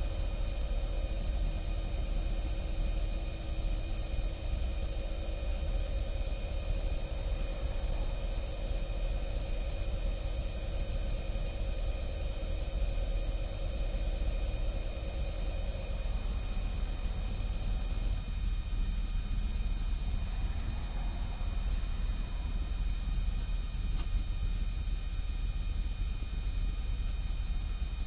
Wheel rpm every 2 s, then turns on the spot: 0, 0, 0, 0, 0, 0, 0, 0, 0, 0, 0, 0, 0, 0.
none